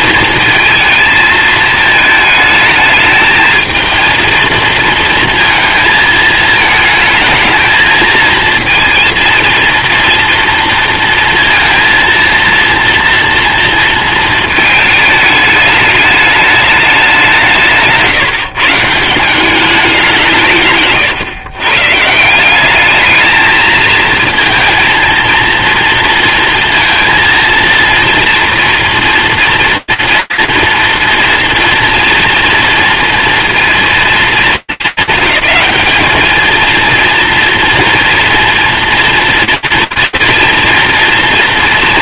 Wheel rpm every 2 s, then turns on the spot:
230, 220, 220, 220, 230, 230, 230, 220, 210, 150, 130, 200, 220, 230, 230, 240, 230, 220, 220, 230, 230.
20-22